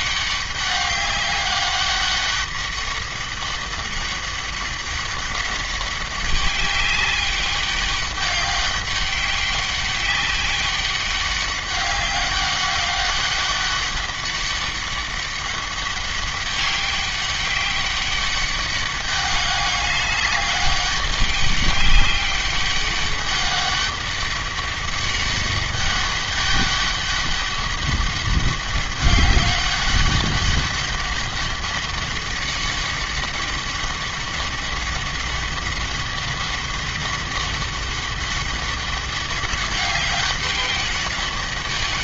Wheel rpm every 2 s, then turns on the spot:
200, 200, 200, 200, 200, 190, 200, 190, 200, 200, 200, 200, 200, 200, 200, 200, 200, 200, 200, 200, 200.
none